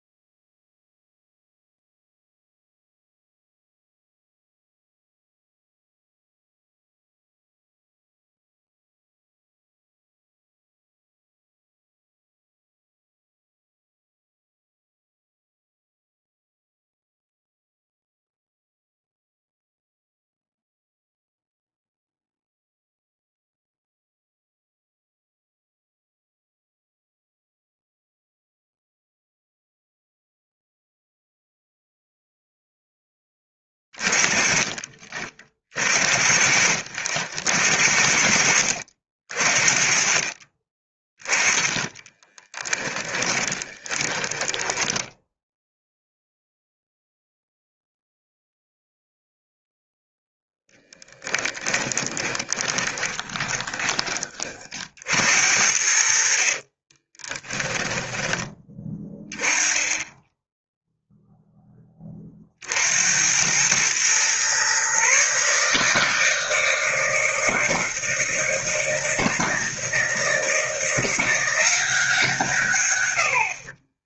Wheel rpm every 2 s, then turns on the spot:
0, 0, 0, 0, 0, 0, 0, 0, 0, 0, 0, 0, 0, 0, 0, 0, 10, 40, 60, 60, 30, 20, 10, 0, 0, 10, 20, 60, 20, 10, 0, 60, 130, 160, 160, 170, 120.
42-46 50-54 56-58